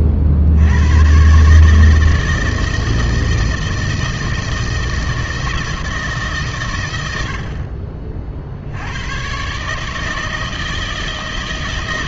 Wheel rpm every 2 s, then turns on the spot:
70, 160, 160, 140, 80, 160.
none